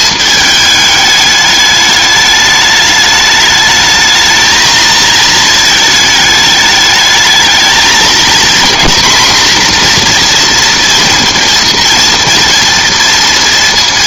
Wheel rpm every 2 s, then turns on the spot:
210, 210, 220, 210, 230, 240, 230.
none